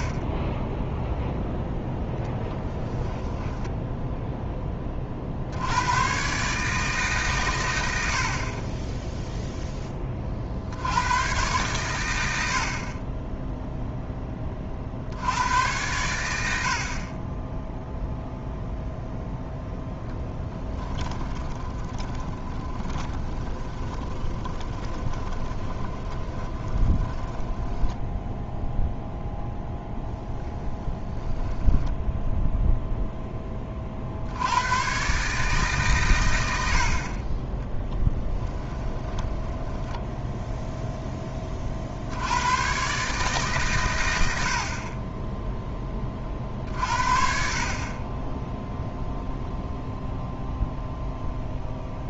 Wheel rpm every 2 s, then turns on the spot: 20, 10, 10, 150, 20, 70, 50, 40, 50, 0, 20, 20, 30, 40, 0, 10, 0, 110, 70, 10, 0, 120, 50, 50, 0, 0.
2-4 20-28 30-32 38-40